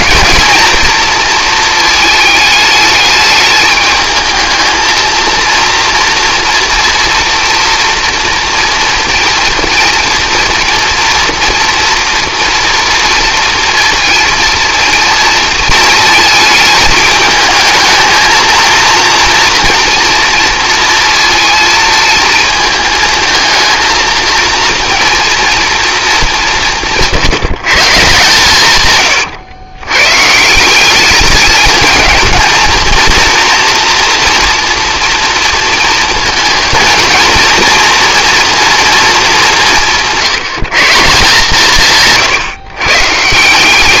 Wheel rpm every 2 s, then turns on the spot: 230, 220, 220, 230, 230, 230, 240, 230, 220, 230, 230, 220, 230, 170, 130, 190, 230, 230, 220, 230, 180, 130.
none